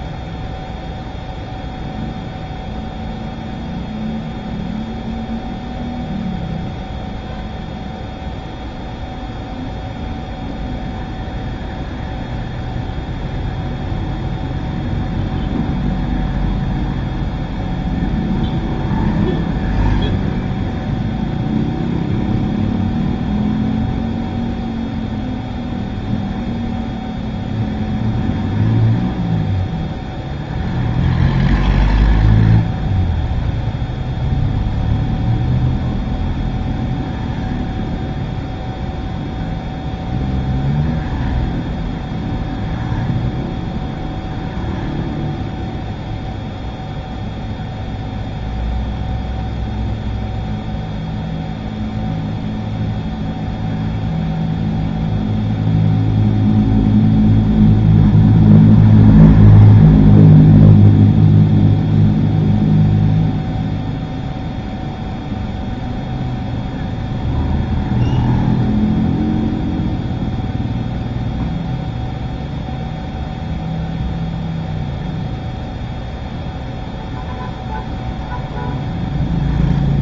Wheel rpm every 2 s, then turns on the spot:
0, 0, 0, 0, 0, 0, 0, 0, 0, 0, 0, 0, 0, 0, 0, 0, 0, 0, 0, 0, 0, 0, 0, 0, 0, 0, 0, 0, 0, 0, 0, 0, 0, 0, 0, 0, 0, 0, 0, 0.
none